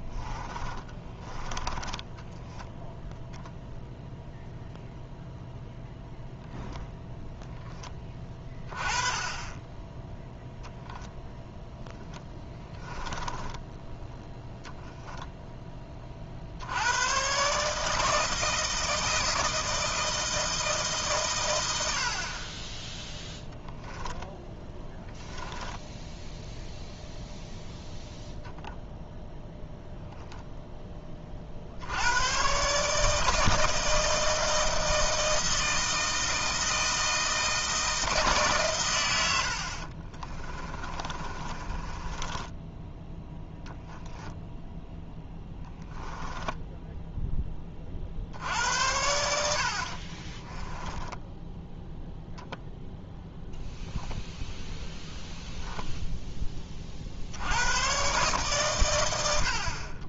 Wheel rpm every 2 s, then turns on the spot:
20, 0, 0, 0, 20, 0, 10, 0, 90, 160, 160, 10, 10, 0, 0, 20, 150, 160, 160, 110, 30, 10, 0, 0, 70, 10, 0, 0, 40, 110.
0-2 12-14 24-26 40-42 50-52